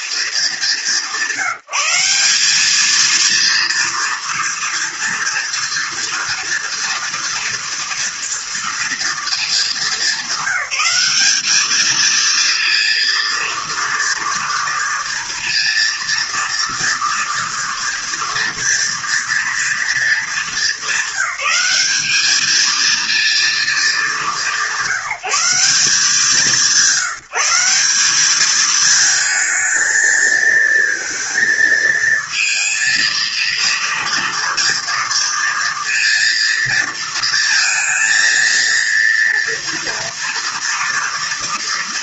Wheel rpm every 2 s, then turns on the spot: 210, 210, 230, 230, 230, 200, 230, 230, 230, 240, 210, 220, 180, 180, 210, 220, 230, 230, 230, 230, 230.
none